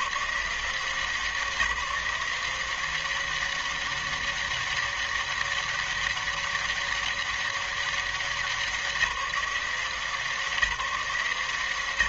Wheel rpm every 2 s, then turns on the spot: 90, 170, 200, 200, 190, 180.
none